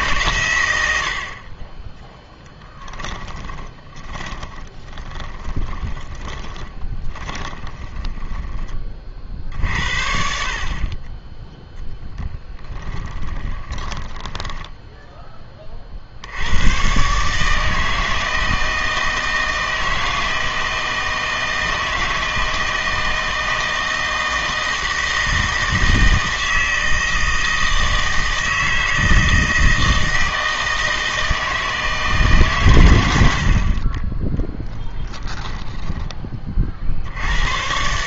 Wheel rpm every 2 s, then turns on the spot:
100, 10, 30, 20, 10, 50, 20, 10, 100, 160, 160, 160, 160, 160, 160, 160, 110, 10, 40.
4-8 12-16